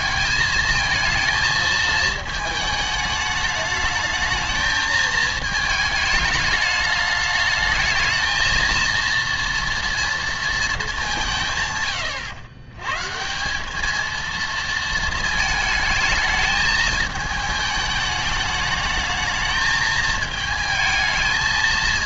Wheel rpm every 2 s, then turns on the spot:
220, 220, 220, 210, 230, 220, 110, 230, 220, 210, 220.
none